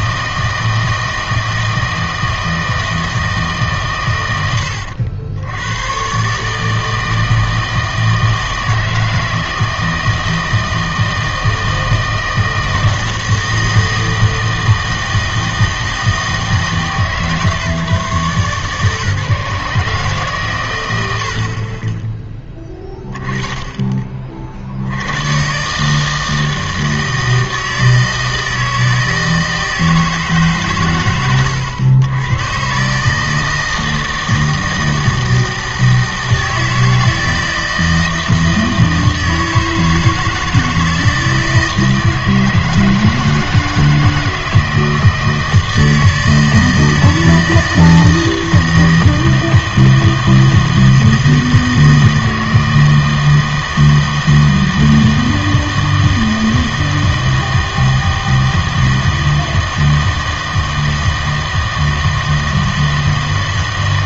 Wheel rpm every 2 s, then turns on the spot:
160, 160, 80, 150, 160, 160, 160, 160, 150, 130, 110, 20, 70, 160, 160, 130, 130, 160, 160, 160, 160, 160, 160, 160, 160, 160, 160, 160, 160, 160, 160, 160.
none